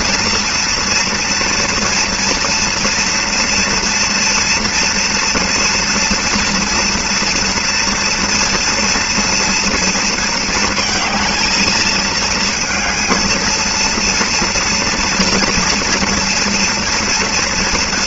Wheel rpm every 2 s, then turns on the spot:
230, 230, 230, 230, 230, 220, 220, 230, 230.
none